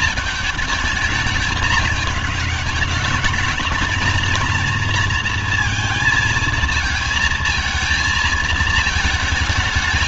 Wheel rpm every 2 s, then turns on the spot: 210, 200, 220, 220, 220.
none